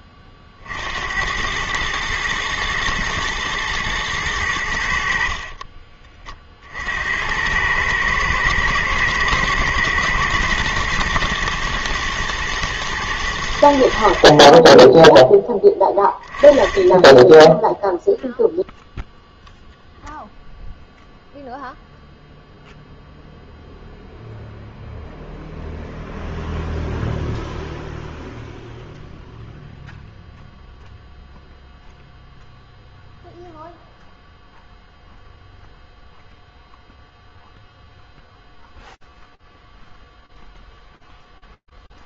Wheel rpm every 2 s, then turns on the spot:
80, 110, 50, 80, 120, 120, 110, 10, 10, 0, 0, 0, 0, 0, 0, 0, 0, 0, 0, 0, 0.
4-6